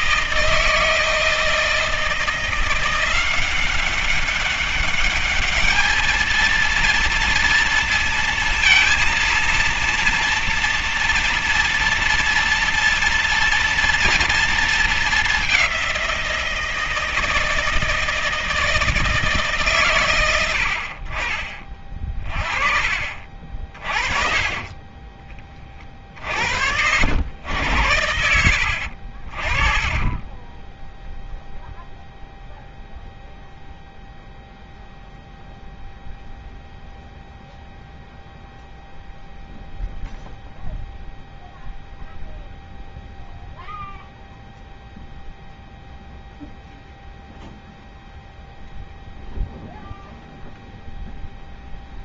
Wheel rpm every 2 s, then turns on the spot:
160, 170, 200, 230, 230, 230, 230, 230, 170, 160, 90, 30, 30, 60, 70, 10, 0, 0, 0, 0, 0, 0, 0, 0, 0, 0.
none